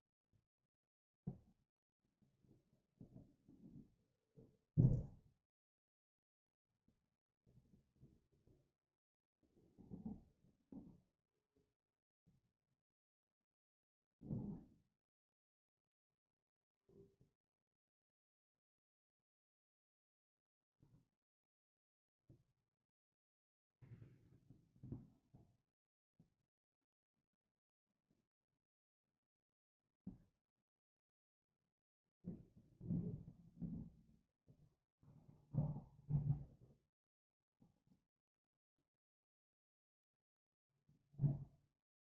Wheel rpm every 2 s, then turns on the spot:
0, 0, 0, 0, 0, 0, 0, 0, 0, 0, 0, 0, 0, 0, 0, 0, 0, 0, 0, 0, 0.
none